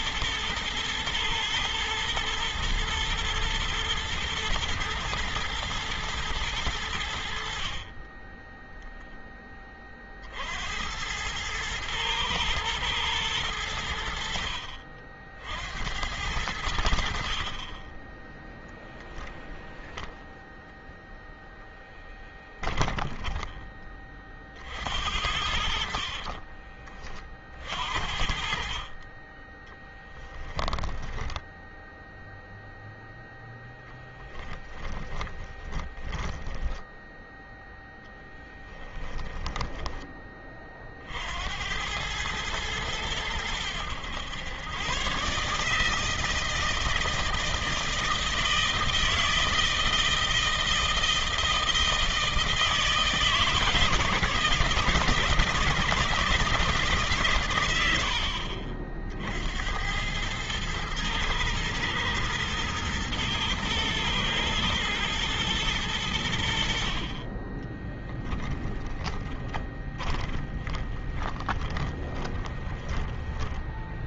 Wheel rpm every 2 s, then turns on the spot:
110, 110, 120, 110, 20, 50, 110, 80, 80, 10, 0, 10, 30, 40, 50, 10, 0, 10, 10, 10, 20, 100, 110, 160, 160, 160, 160, 150, 160, 70, 100, 110, 110, 90, 10, 10, 20.
22-24 26-28 30-32 34-38 68-74